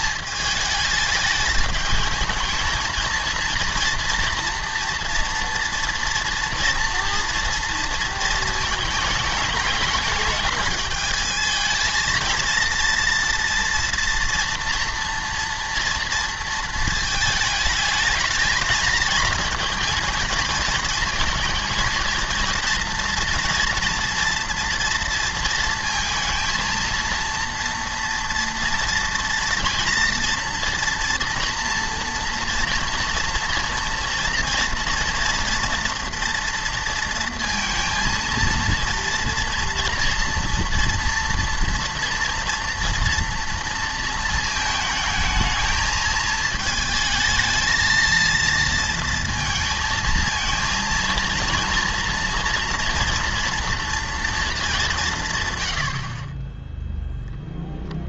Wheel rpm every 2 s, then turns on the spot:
210, 220, 230, 230, 220, 210, 230, 230, 230, 220, 230, 230, 230, 230, 230, 230, 230, 230, 230, 230, 230, 230, 220, 220, 230, 220, 230, 210, 10.
none